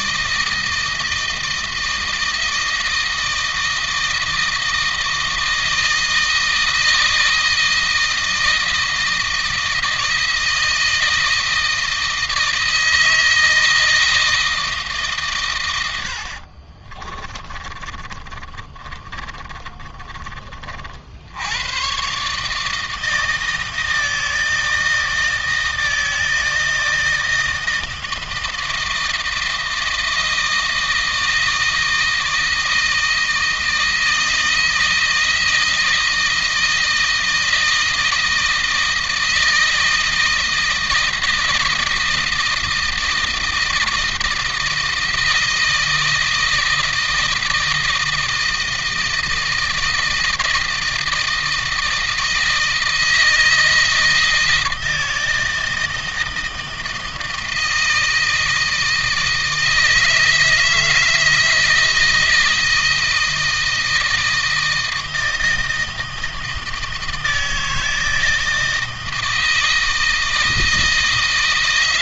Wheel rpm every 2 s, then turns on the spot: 160, 160, 160, 160, 160, 160, 160, 150, 30, 40, 50, 160, 160, 160, 160, 160, 160, 160, 160, 160, 160, 160, 160, 160, 160, 160, 160, 160, 160, 160, 160, 160, 160, 160, 160, 160.
16-20